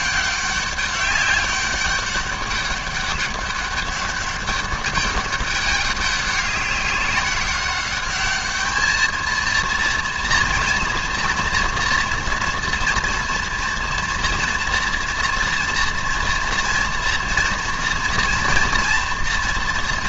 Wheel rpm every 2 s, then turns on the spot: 200, 200, 200, 190, 210, 230, 230, 240, 230, 230.
none